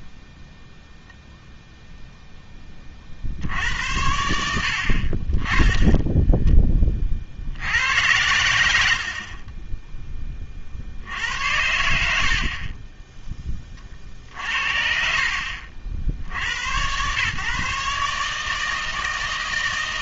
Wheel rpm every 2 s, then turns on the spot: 0, 20, 50, 20, 80, 50, 30, 60, 80, 160.
14-16